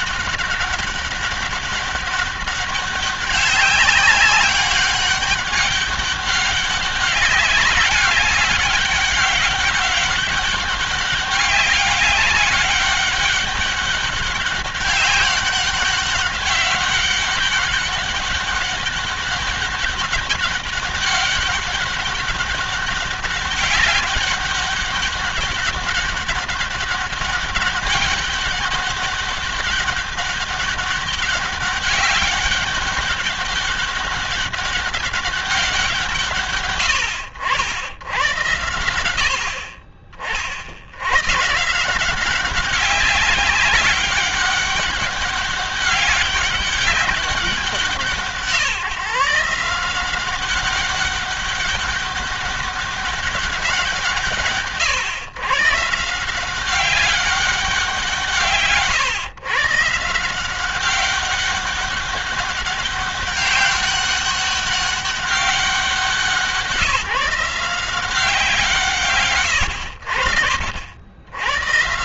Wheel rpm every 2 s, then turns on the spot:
200, 190, 200, 200, 200, 200, 200, 200, 200, 200, 200, 200, 200, 200, 200, 200, 200, 200, 130, 90, 80, 190, 200, 190, 160, 190, 200, 140, 190, 140, 190, 200, 200, 170, 160, 80.
none